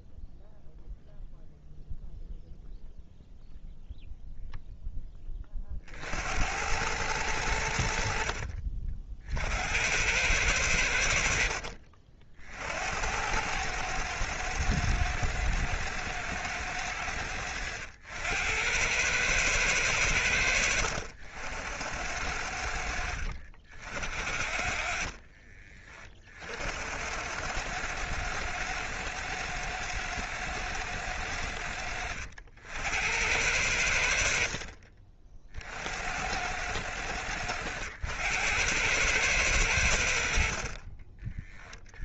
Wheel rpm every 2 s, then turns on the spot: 0, 0, 10, 90, 50, 80, 80, 110, 100, 100, 80, 80, 50, 90, 110, 100, 80, 40, 100, 100, 40.
24-26